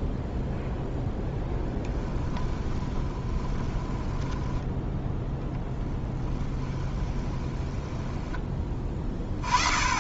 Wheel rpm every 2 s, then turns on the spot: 0, 20, 10, 10, 10.
2-4 6-8